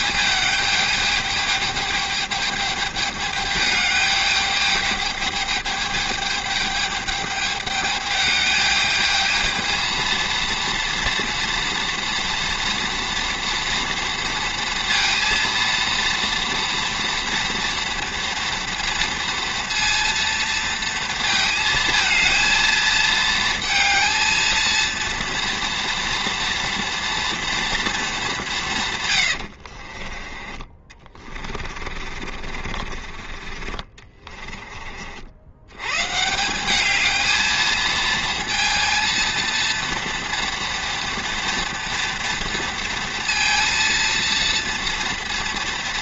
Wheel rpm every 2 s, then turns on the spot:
210, 210, 210, 210, 210, 230, 230, 230, 230, 230, 230, 220, 230, 240, 170, 20, 40, 30, 190, 230, 230, 230, 230.
30-34